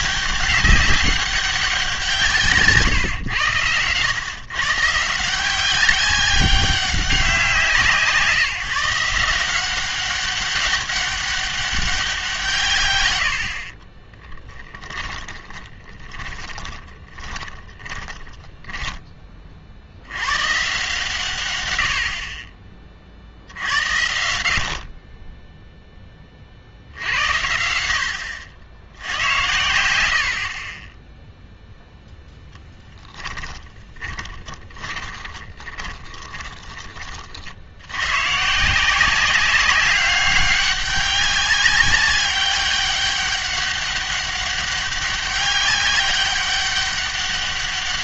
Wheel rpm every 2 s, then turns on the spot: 200, 140, 140, 190, 160, 200, 140, 10, 20, 10, 130, 30, 50, 60, 80, 30, 10, 20, 20, 150, 200, 200, 200, 200.
14-20 32-38